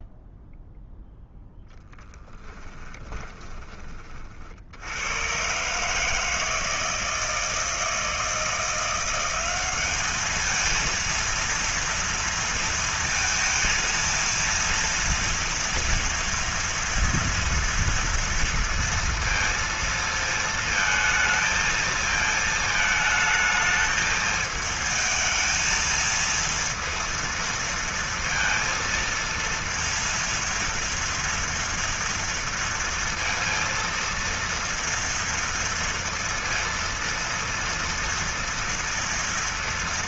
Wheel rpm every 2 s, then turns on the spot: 0, 10, 90, 160, 180, 230, 230, 230, 230, 230, 230, 220, 220, 230, 230, 230, 230, 230, 230, 230.
2-4